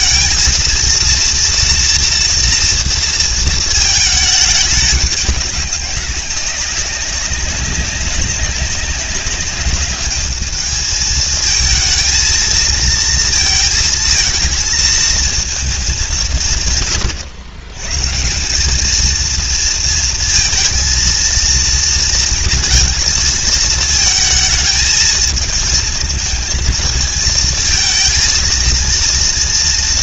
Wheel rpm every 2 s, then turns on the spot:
230, 230, 210, 190, 200, 220, 230, 220, 130, 210, 230, 230, 220, 220, 230.
none